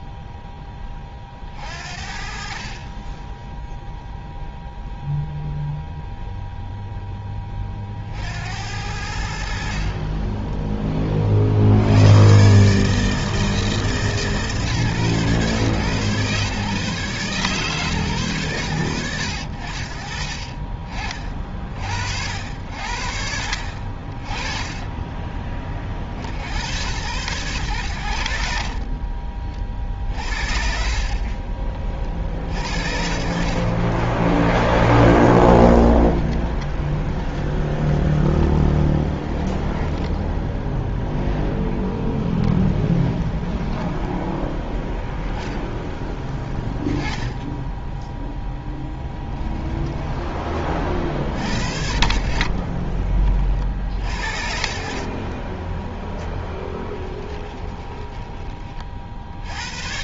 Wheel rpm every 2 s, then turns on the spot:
10, 40, 0, 10, 70, 30, 160, 140, 140, 90, 40, 50, 30, 110, 40, 40, 40, 0, 20, 10, 10, 20, 0, 10, 10, 40, 20, 40, 20, 50.
30-32 36-40 42-44 48-50 54-58